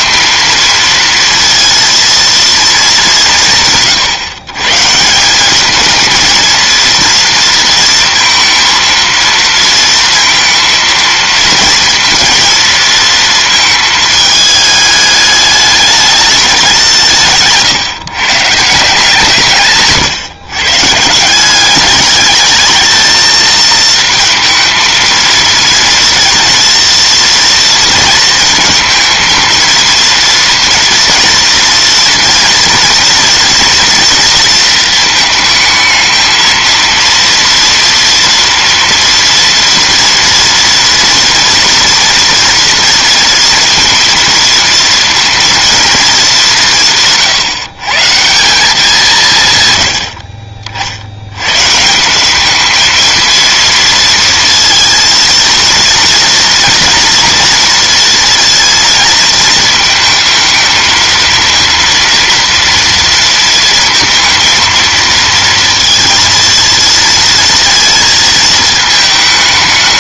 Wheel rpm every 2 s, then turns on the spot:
230, 230, 140, 230, 230, 230, 230, 210, 190, 160, 140, 210, 220, 230, 230, 230, 230, 230, 230, 230, 230, 230, 230, 180, 180, 50, 210, 230, 230, 230, 230, 230, 230, 230, 220.
none